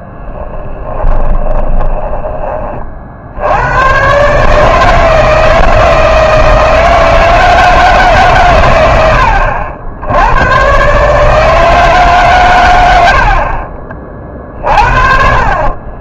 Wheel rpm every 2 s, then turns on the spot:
20, 40, 160, 160, 90, 130, 90, 40.
0-2 14-16